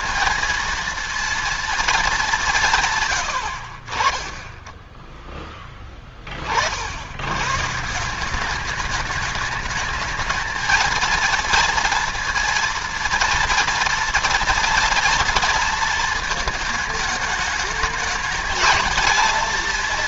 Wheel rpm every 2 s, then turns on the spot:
230, 140, 10, 70, 200, 220, 230, 230, 220, 220.
none